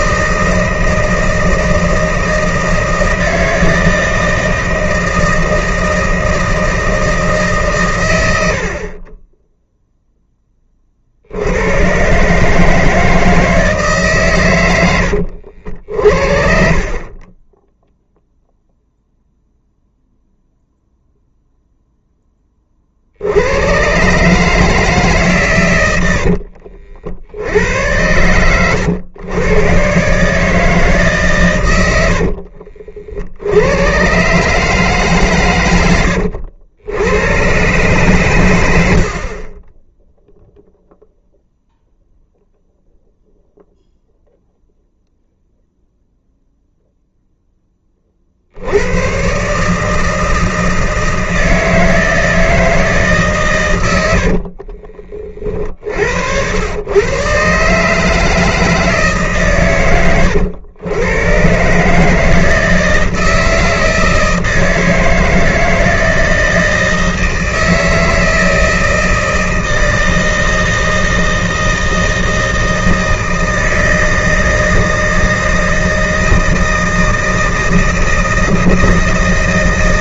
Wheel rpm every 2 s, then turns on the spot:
160, 160, 160, 160, 70, 20, 150, 100, 40, 0, 0, 30, 150, 70, 110, 150, 50, 140, 80, 100, 0, 0, 0, 0, 80, 160, 160, 50, 100, 160, 110, 160, 160, 160, 160, 160, 160, 160, 160, 160.
32-34 54-56